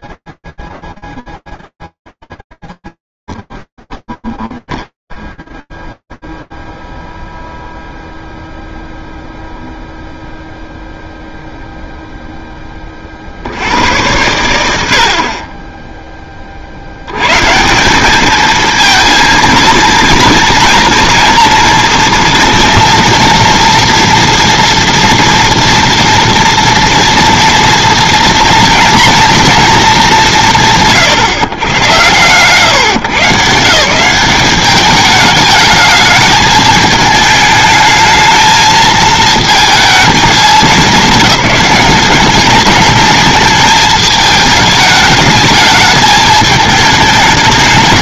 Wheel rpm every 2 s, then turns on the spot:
0, 0, 0, 0, 0, 0, 20, 80, 90, 230, 230, 230, 230, 230, 240, 110, 150, 210, 220, 220, 190, 220, 210, 210.
none